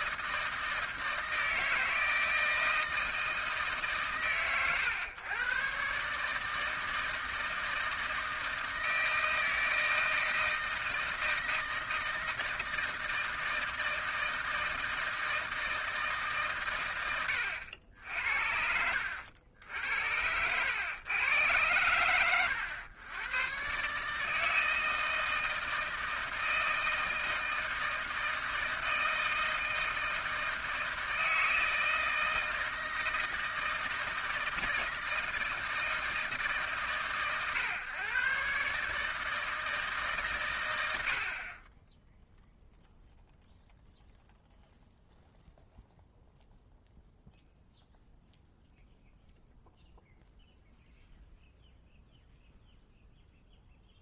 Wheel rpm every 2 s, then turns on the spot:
160, 160, 120, 160, 160, 160, 160, 160, 130, 70, 100, 110, 160, 160, 160, 160, 160, 160, 140, 140, 100, 0, 0, 0, 0, 0, 0.
18-20